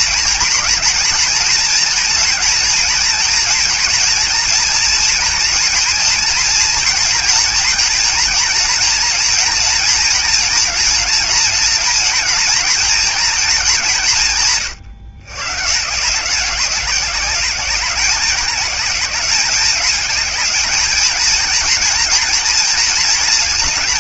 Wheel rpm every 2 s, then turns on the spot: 230, 230, 230, 220, 230, 230, 230, 90, 190, 210, 220, 230.
none